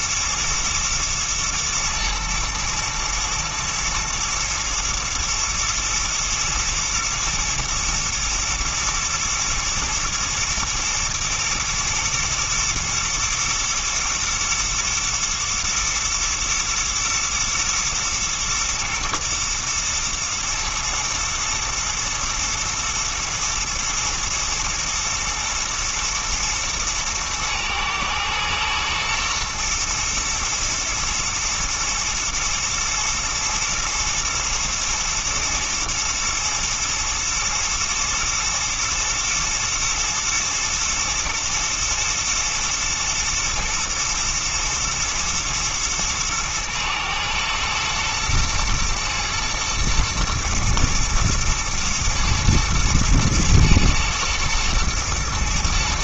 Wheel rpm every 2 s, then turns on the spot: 110, 120, 120, 110, 110, 110, 120, 110, 110, 110, 120, 110, 120, 110, 120, 120, 120, 110, 120, 110, 110, 110, 110, 110, 110, 120, 110, 120.
none